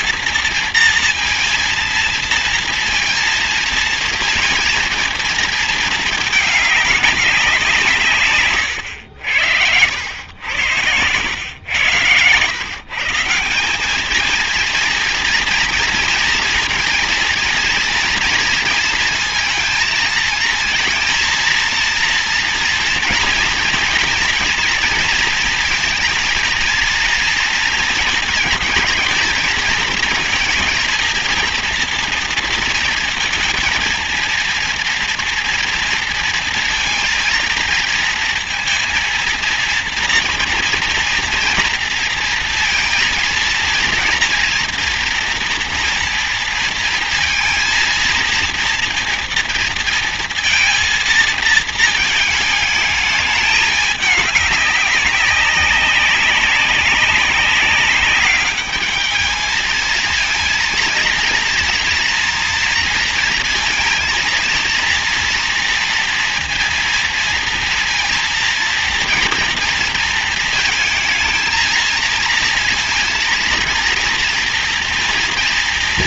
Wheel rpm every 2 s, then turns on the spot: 230, 230, 230, 210, 120, 110, 140, 230, 230, 230, 230, 230, 230, 230, 230, 230, 230, 230, 230, 230, 230, 230, 230, 230, 230, 230, 220, 190, 190, 210, 230, 230, 230, 230, 230, 230, 230, 230.
none